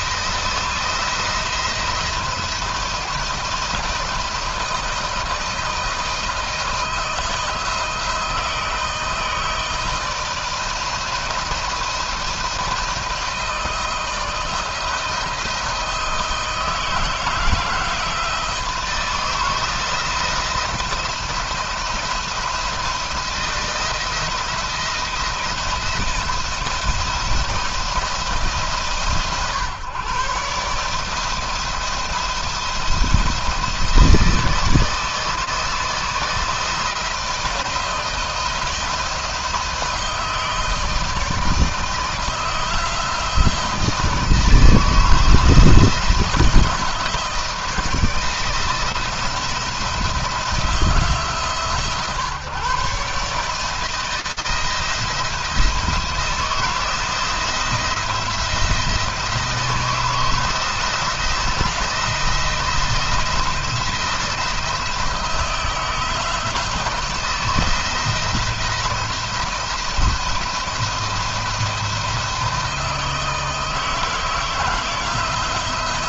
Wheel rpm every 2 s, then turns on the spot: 170, 170, 160, 170, 160, 170, 160, 170, 160, 160, 170, 160, 170, 170, 140, 150, 160, 160, 160, 160, 160, 170, 160, 160, 160, 160, 140, 160, 170, 170, 160, 170, 160, 160, 170, 170, 160, 160.
none